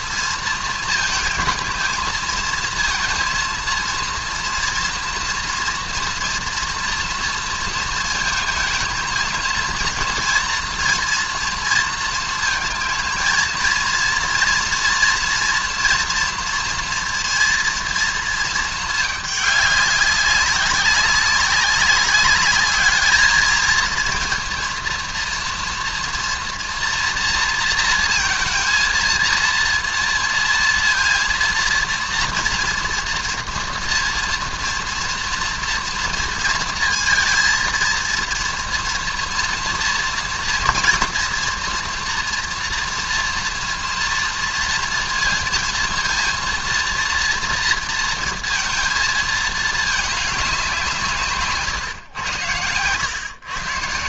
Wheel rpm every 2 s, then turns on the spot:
230, 220, 230, 240, 230, 230, 220, 230, 230, 220, 190, 210, 230, 240, 230, 230, 230, 230, 230, 230, 230, 230, 230, 230, 220, 180, 110.
none